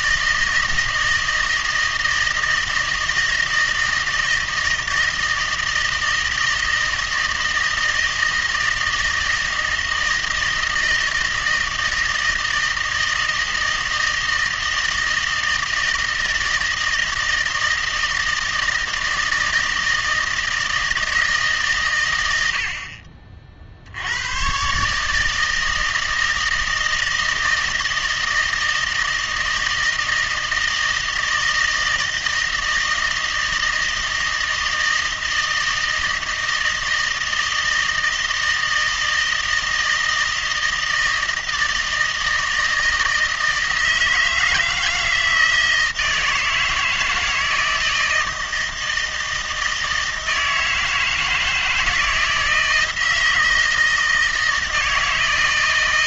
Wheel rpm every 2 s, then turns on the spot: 160, 160, 160, 160, 160, 160, 160, 160, 160, 160, 160, 80, 140, 160, 160, 160, 160, 160, 160, 160, 160, 160, 160, 160, 160, 160, 160, 160.
none